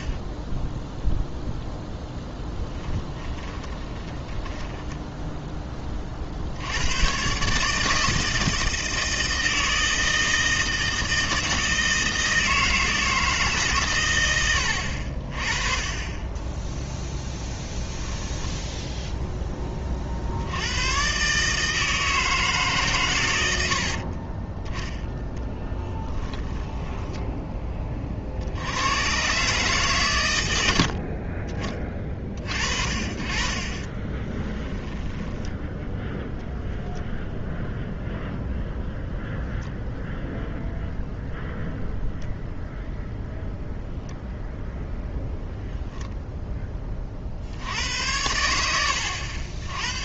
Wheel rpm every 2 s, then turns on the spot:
0, 10, 10, 90, 160, 160, 160, 70, 10, 10, 90, 140, 10, 20, 100, 80, 40, 10, 0, 0, 0, 0, 0, 20, 90.
2-6 18-20 26-28 30-32 34-36